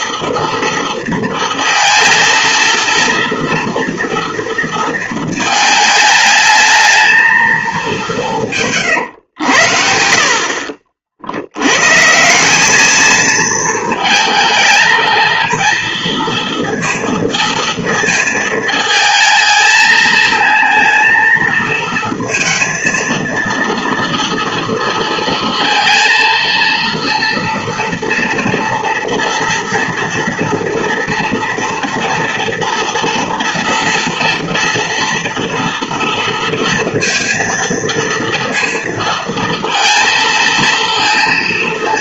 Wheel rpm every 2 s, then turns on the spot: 230, 230, 220, 220, 120, 70, 220, 220, 230, 220, 230, 230, 230, 230, 230, 230, 230, 230, 230, 230, 230.
none